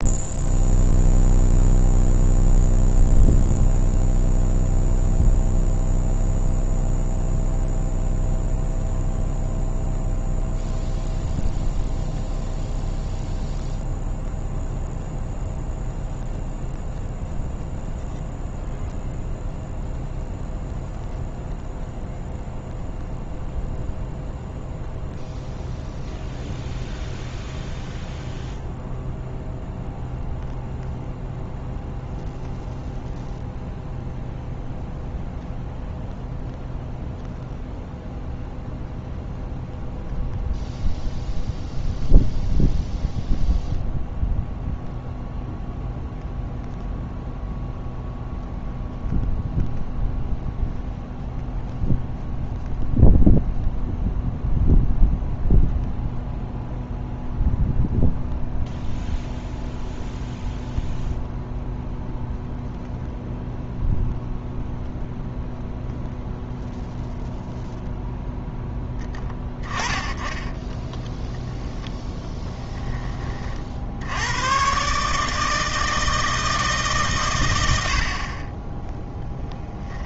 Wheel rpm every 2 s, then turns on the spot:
0, 0, 0, 0, 0, 0, 0, 0, 0, 0, 0, 0, 0, 0, 0, 0, 0, 0, 0, 0, 0, 0, 0, 0, 0, 0, 0, 0, 0, 0, 0, 0, 0, 0, 0, 10, 20, 120, 150, 20.
70-72